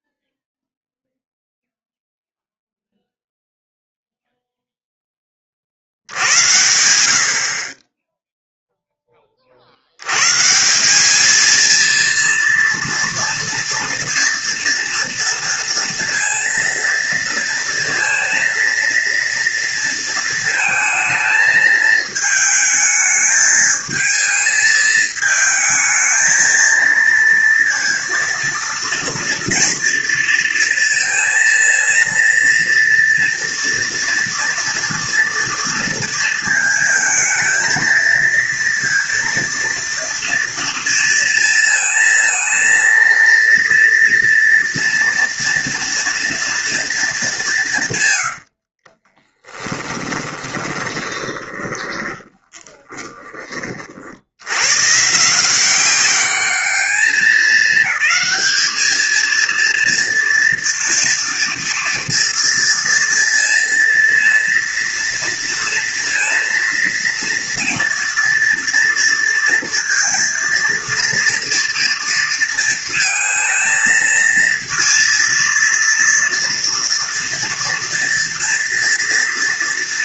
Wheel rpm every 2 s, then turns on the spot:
0, 0, 0, 80, 0, 160, 230, 230, 230, 230, 220, 220, 220, 230, 230, 230, 230, 230, 230, 230, 230, 230, 230, 230, 60, 20, 30, 100, 210, 220, 230, 230, 230, 230, 230, 230, 230, 230, 230, 230.
48-54